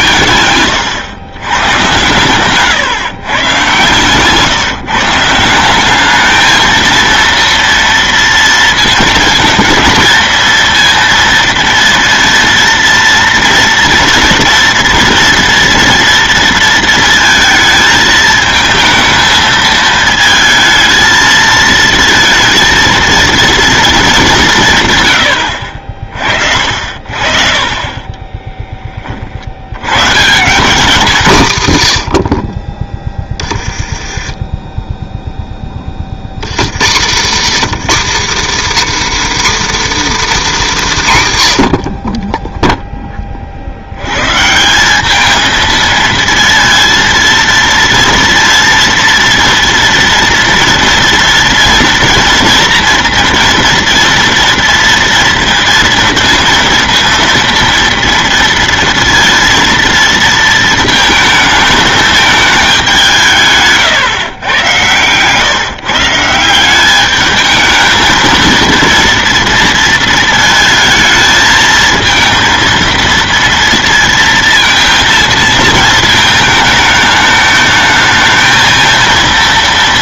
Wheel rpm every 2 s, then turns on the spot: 110, 130, 150, 220, 230, 230, 230, 240, 230, 220, 220, 230, 190, 50, 20, 170, 40, 20, 110, 270, 270, 10, 150, 230, 230, 230, 230, 230, 230, 230, 230, 210, 110, 170, 220, 220, 230, 230, 220, 220.
2-4 34-36